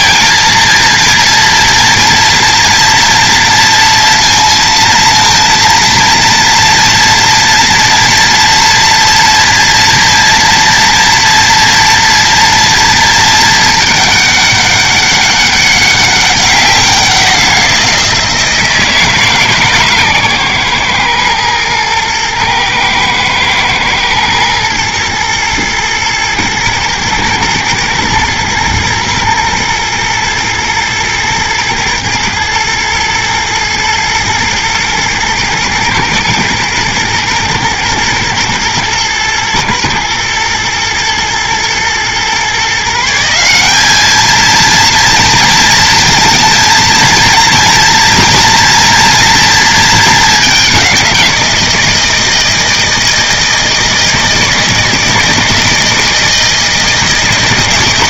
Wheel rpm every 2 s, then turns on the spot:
230, 230, 230, 230, 240, 240, 230, 200, 180, 160, 120, 110, 120, 110, 120, 110, 110, 110, 110, 110, 110, 160, 230, 230, 230, 200, 170, 160, 160.
none